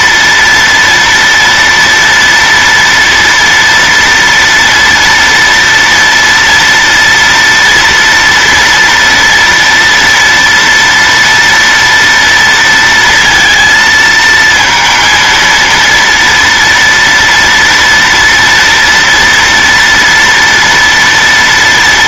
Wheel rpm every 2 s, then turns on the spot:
240, 230, 230, 230, 230, 230, 230, 230, 230, 240, 230.
none